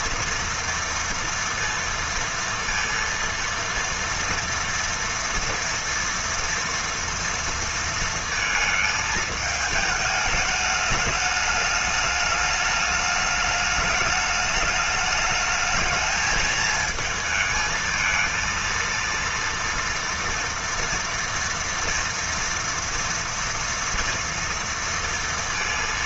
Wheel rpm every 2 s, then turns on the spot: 230, 230, 230, 240, 220, 210, 210, 210, 220, 230, 230, 230, 230.
none